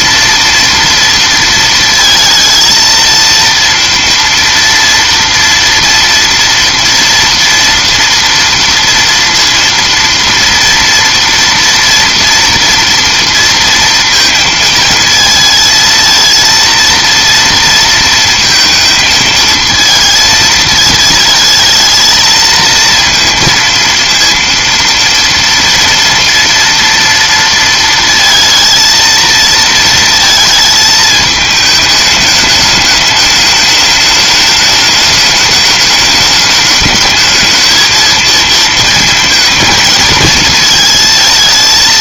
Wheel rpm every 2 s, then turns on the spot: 230, 230, 230, 240, 230, 230, 230, 230, 230, 220, 220, 230, 230, 230, 230, 220, 210, 210, 210, 230, 220.
none